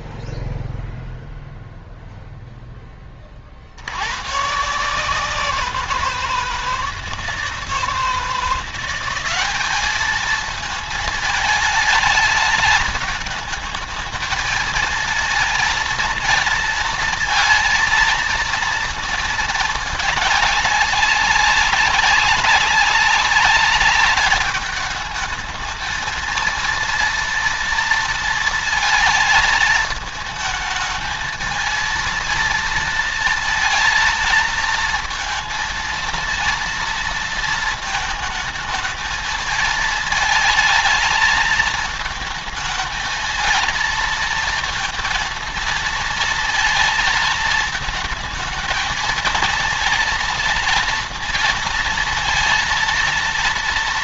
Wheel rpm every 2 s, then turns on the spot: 0, 20, 170, 160, 180, 220, 220, 220, 230, 230, 200, 200, 210, 230, 220, 220, 230, 230, 230, 220, 220, 220, 230, 230, 220, 230, 230.
none